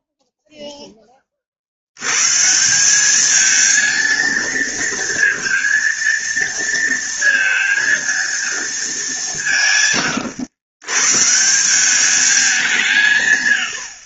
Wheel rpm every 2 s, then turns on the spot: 0, 150, 230, 230, 230, 110, 190.
none